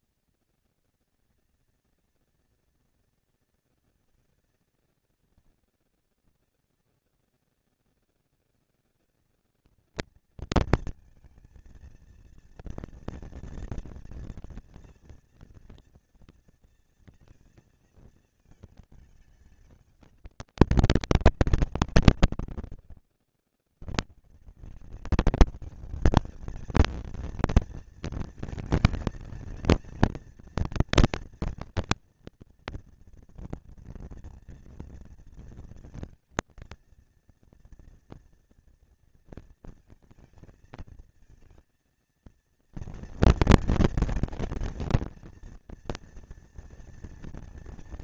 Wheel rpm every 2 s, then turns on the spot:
230, 230, 230, 230, 230, 230, 230, 230, 230, 220, 200, 150, 120, 210, 230, 240, 240, 230, 230, 230, 230, 230, 230, 230.
none